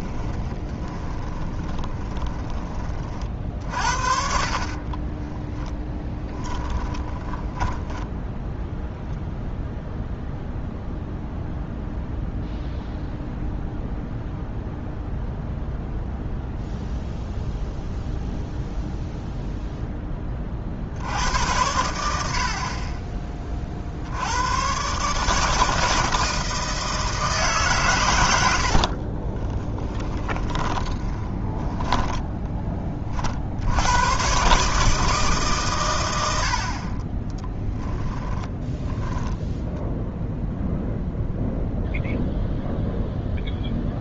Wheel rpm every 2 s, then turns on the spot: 20, 20, 30, 10, 0, 0, 0, 0, 0, 0, 40, 40, 120, 160, 70, 30, 30, 150, 60, 10, 0, 0.
0-2 4-8 28-32 38-40